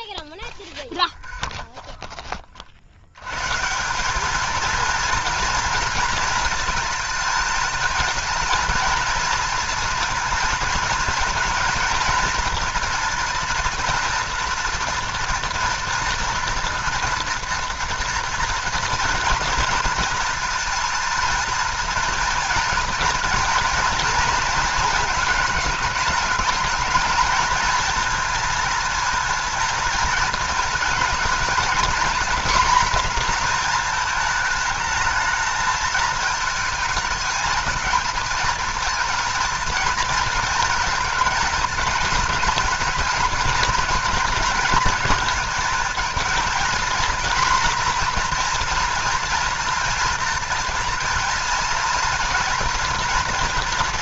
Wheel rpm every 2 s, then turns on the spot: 20, 60, 230, 220, 230, 220, 230, 230, 230, 230, 230, 230, 220, 210, 230, 220, 250, 220, 220, 230, 220, 220, 220, 230, 240, 230, 230.
0-2